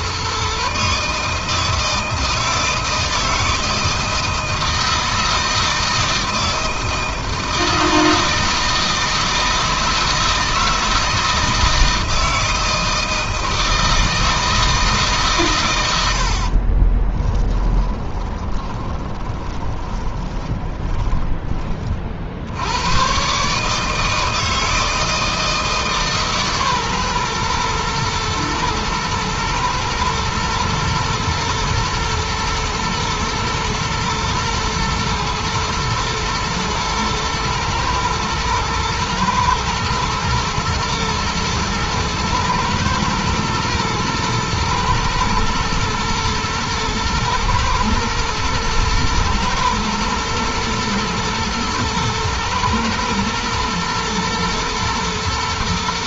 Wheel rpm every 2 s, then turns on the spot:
140, 160, 160, 160, 160, 160, 160, 160, 40, 20, 20, 70, 160, 140, 120, 110, 110, 120, 120, 120, 120, 110, 110, 120, 110, 110, 120, 120.
16-22